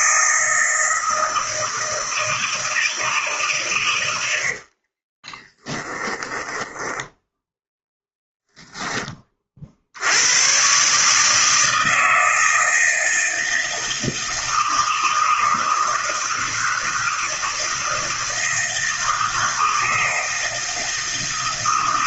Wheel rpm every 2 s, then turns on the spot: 160, 160, 70, 10, 0, 120, 160, 160, 160, 160, 160.
4-8